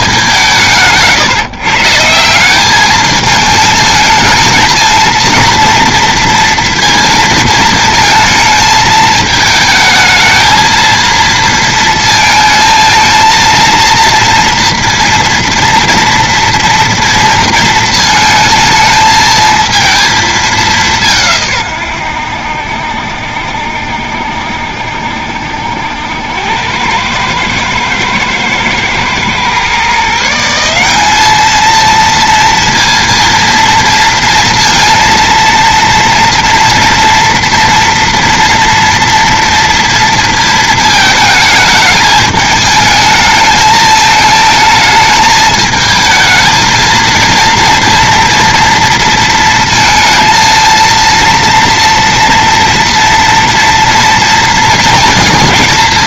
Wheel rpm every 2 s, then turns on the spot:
160, 200, 220, 230, 220, 230, 220, 230, 230, 220, 190, 70, 60, 90, 110, 180, 230, 230, 230, 230, 220, 210, 220, 230, 230, 230, 230, 230.
none